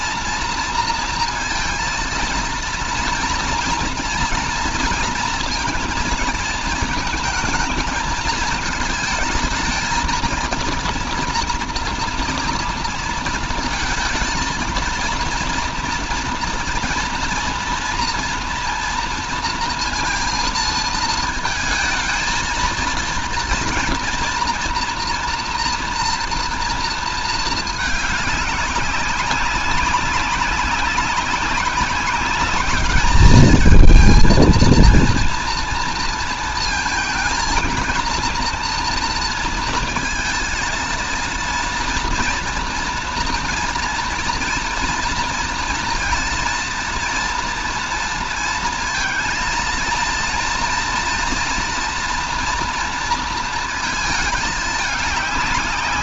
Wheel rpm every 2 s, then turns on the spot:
230, 230, 230, 220, 220, 230, 230, 230, 230, 230, 220, 230, 230, 230, 200, 200, 210, 230, 230, 230, 230, 230, 230, 230, 230, 230, 230, 210.
none